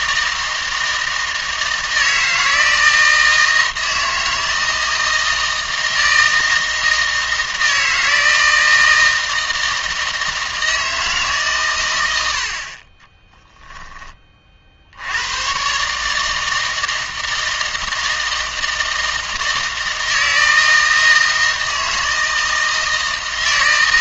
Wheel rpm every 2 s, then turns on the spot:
160, 160, 160, 160, 160, 160, 50, 50, 160, 160, 160, 160.
none